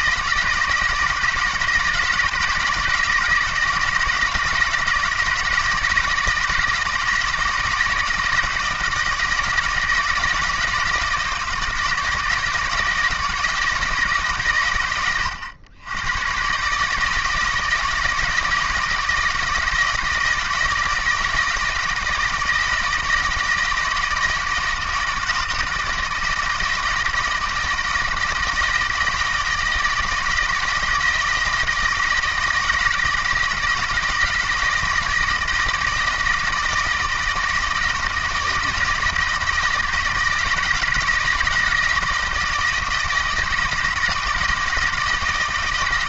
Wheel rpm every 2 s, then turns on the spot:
170, 160, 160, 160, 160, 160, 160, 100, 140, 160, 160, 160, 160, 160, 160, 160, 160, 160, 160, 160, 160, 160, 160.
none